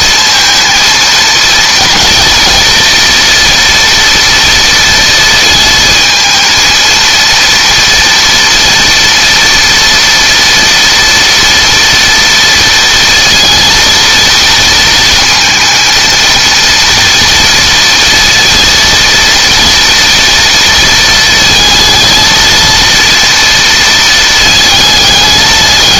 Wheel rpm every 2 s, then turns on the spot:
230, 230, 230, 230, 230, 230, 230, 230, 230, 230, 230, 230, 220.
none